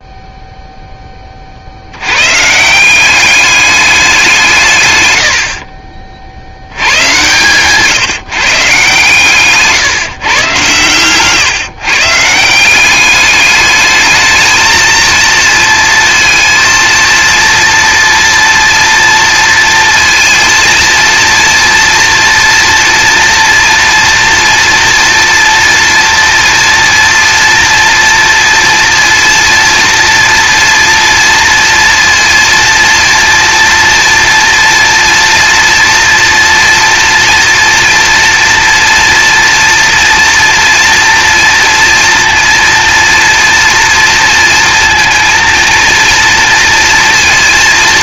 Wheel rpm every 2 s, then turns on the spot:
0, 160, 140, 70, 150, 130, 180, 220, 230, 230, 230, 240, 230, 230, 230, 230, 230, 230, 230, 230, 230, 230, 230, 230.
none